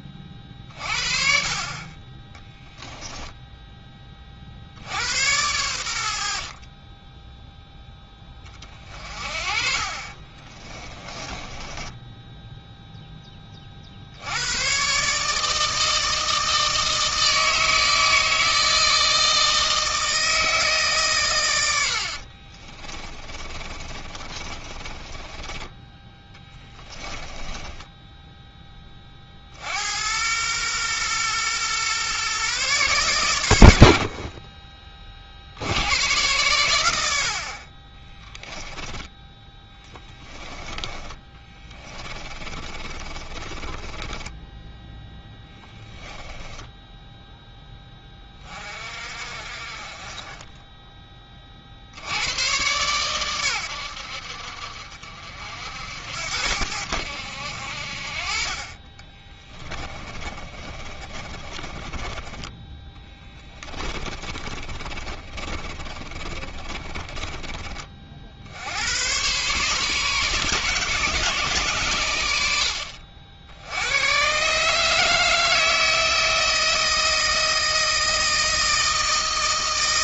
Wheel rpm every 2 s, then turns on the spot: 40, 10, 80, 20, 30, 20, 0, 130, 160, 160, 150, 40, 30, 10, 20, 120, 130, 30, 90, 10, 20, 30, 10, 10, 40, 10, 120, 60, 80, 30, 30, 20, 30, 30, 90, 140, 70, 150, 160, 160.
2-4 10-12 22-28 38-44 46-48 60-68